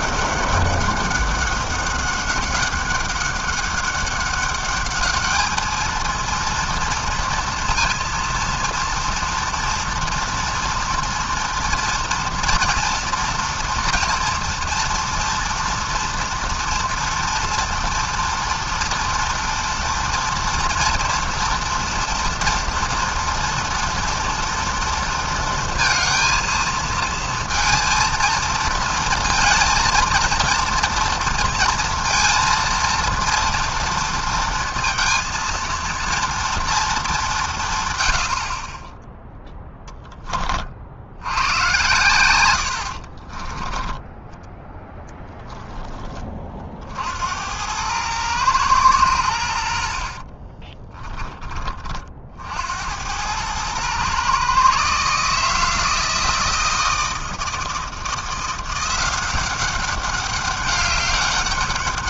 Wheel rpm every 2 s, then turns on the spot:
200, 190, 200, 230, 230, 230, 230, 230, 230, 230, 230, 230, 230, 220, 230, 230, 230, 230, 230, 50, 40, 100, 10, 40, 110, 30, 60, 130, 160, 170, 200.
50-52